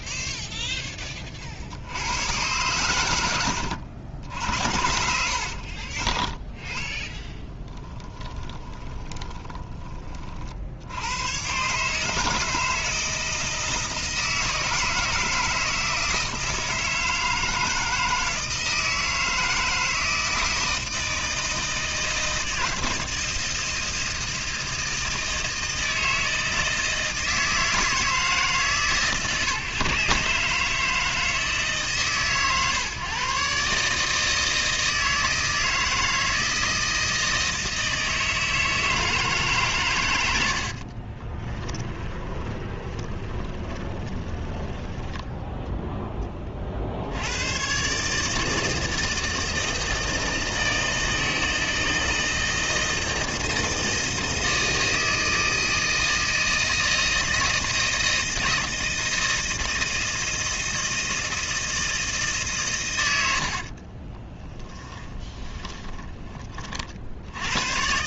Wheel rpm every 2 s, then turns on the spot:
0, 100, 60, 10, 20, 60, 160, 160, 160, 160, 160, 160, 160, 160, 150, 150, 130, 160, 160, 160, 60, 20, 10, 40, 160, 160, 160, 160, 160, 160, 160, 120, 10, 30.
4-6 8-10 40-46 64-66